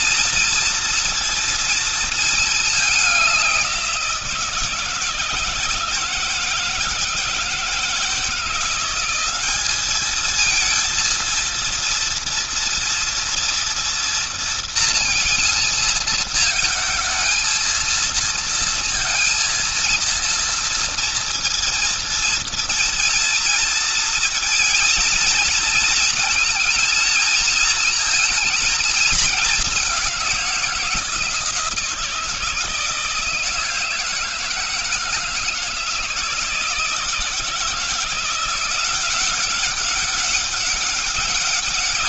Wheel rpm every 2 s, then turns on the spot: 230, 220, 170, 160, 170, 220, 230, 230, 220, 230, 230, 230, 230, 230, 220, 180, 160, 160, 160, 170, 200.
none